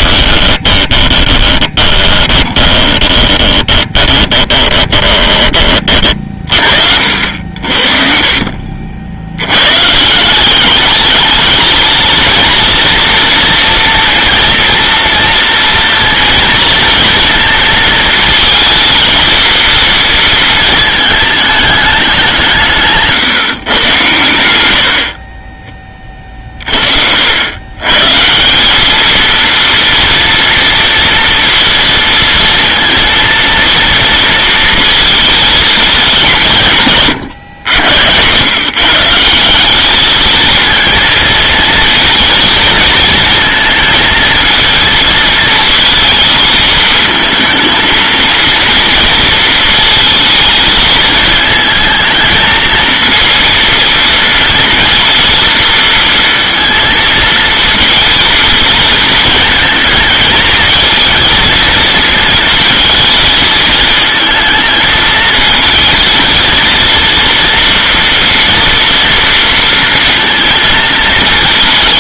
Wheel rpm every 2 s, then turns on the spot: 20, 20, 30, 50, 60, 200, 230, 230, 230, 220, 220, 160, 70, 50, 190, 230, 230, 230, 150, 140, 220, 220, 220, 220, 230, 220, 220, 230, 230, 220, 220, 220, 220, 230, 230, 220.
0-6